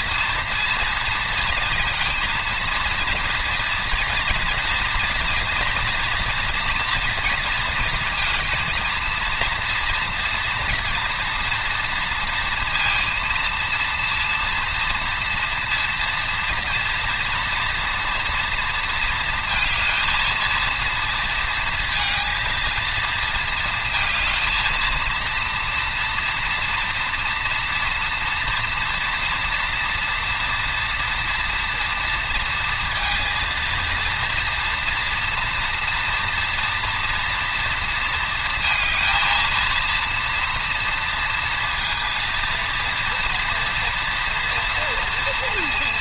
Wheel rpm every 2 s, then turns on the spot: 230, 230, 230, 230, 230, 230, 230, 230, 240, 230, 230, 220, 230, 240, 230, 240, 230, 230, 230, 230, 230, 230, 230.
none